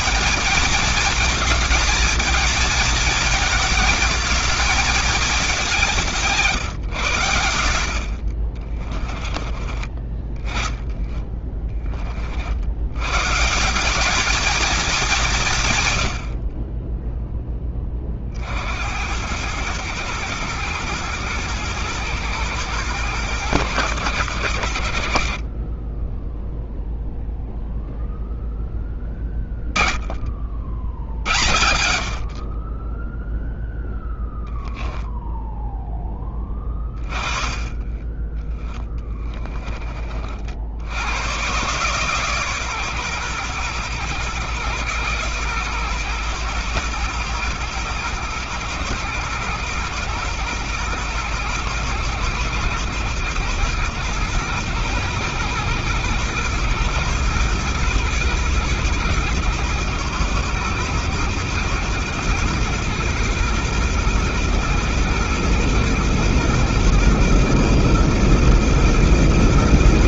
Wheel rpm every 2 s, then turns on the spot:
220, 220, 220, 150, 50, 10, 70, 230, 70, 40, 110, 120, 100, 10, 0, 50, 50, 0, 10, 20, 50, 140, 120, 120, 120, 120, 110, 120, 120, 120, 120, 120, 120, 120, 120.
8-10 36-38